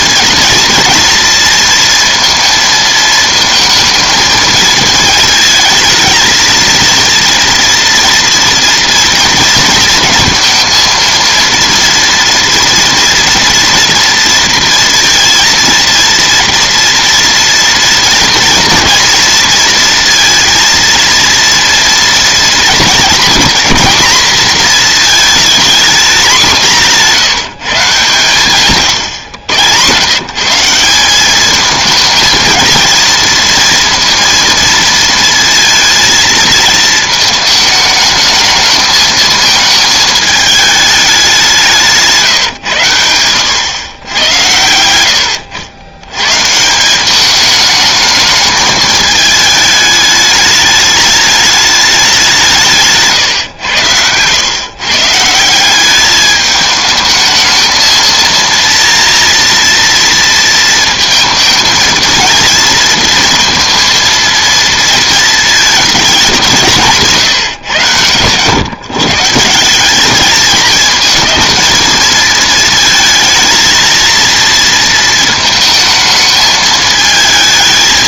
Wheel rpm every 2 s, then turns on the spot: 230, 230, 220, 230, 230, 230, 230, 230, 230, 230, 230, 230, 230, 190, 140, 170, 230, 230, 230, 220, 210, 110, 100, 160, 220, 210, 160, 120, 210, 230, 230, 230, 230, 180, 130, 220, 220, 230, 220.
26-28